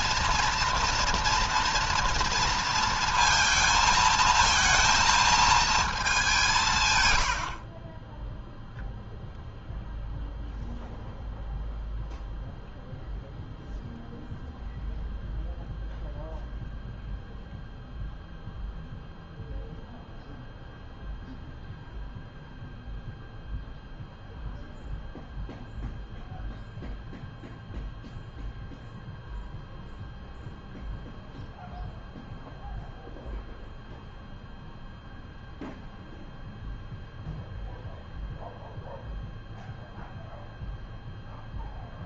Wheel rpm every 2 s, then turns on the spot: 230, 230, 220, 130, 0, 0, 0, 0, 0, 0, 0, 0, 0, 0, 0, 0, 0, 0, 0, 0, 0.
none